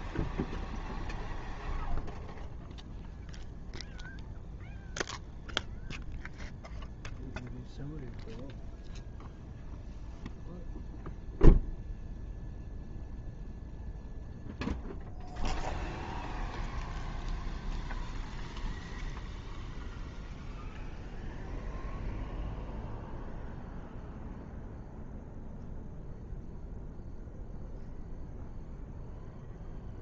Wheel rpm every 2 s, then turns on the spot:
0, 0, 0, 0, 0, 0, 0, 0, 0, 0, 0, 0, 0, 0, 0.
none